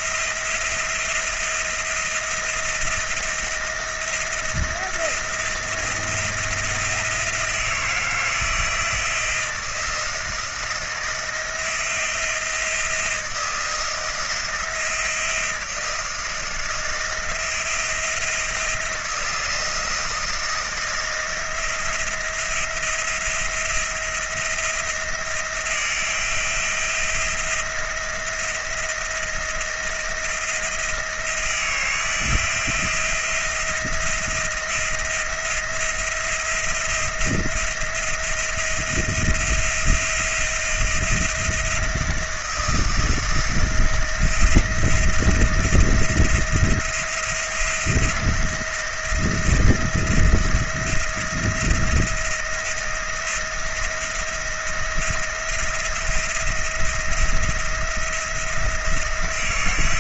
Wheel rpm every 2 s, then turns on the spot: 170, 170, 170, 170, 170, 170, 160, 160, 170, 170, 170, 170, 170, 170, 170, 160, 170, 170, 170, 170, 170, 170, 170, 170, 170, 170, 170, 170, 170, 170.
none